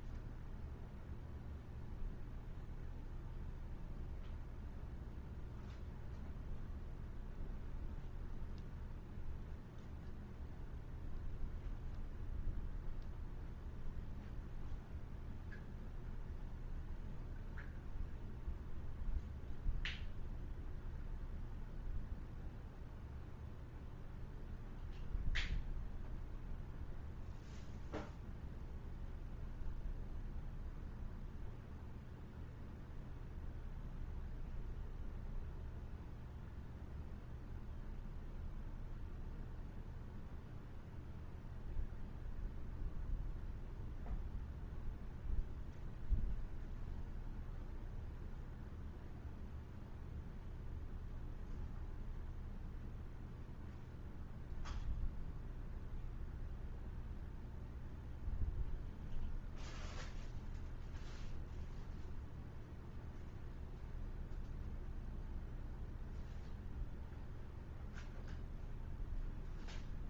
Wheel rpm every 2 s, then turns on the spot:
0, 0, 0, 0, 0, 0, 0, 0, 0, 0, 0, 0, 0, 0, 0, 0, 0, 0, 0, 0, 0, 0, 0, 0, 0, 0, 0, 0, 0, 0, 0, 0, 0, 0, 0.
none